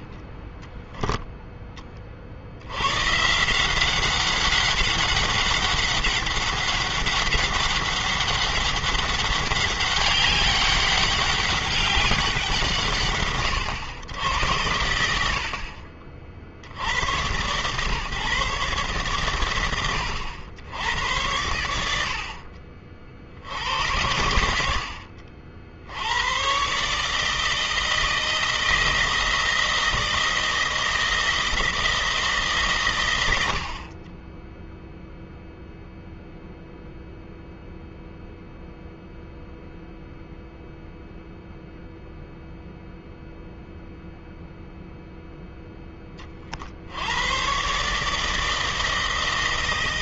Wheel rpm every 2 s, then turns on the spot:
10, 110, 190, 200, 200, 200, 150, 80, 90, 120, 90, 60, 60, 140, 170, 160, 110, 0, 0, 0, 0, 0, 0, 80, 160.
none